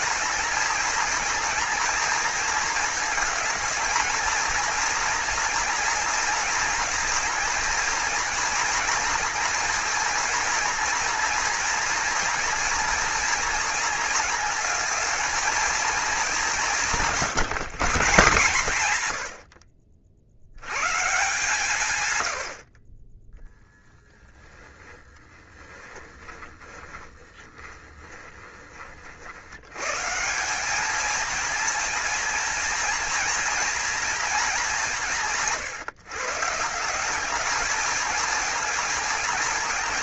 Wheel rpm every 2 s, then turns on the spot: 230, 230, 240, 230, 240, 230, 240, 230, 180, 130, 130, 40, 10, 20, 40, 210, 240, 190, 170, 220.
24-28